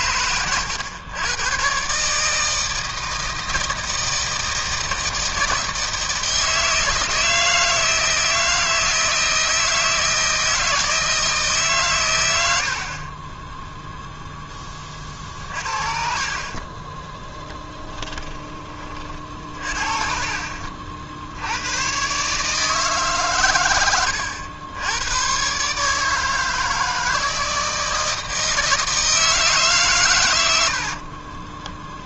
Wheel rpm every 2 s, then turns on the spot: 100, 150, 160, 160, 160, 160, 100, 10, 40, 20, 40, 140, 90, 160, 160, 110.
16-20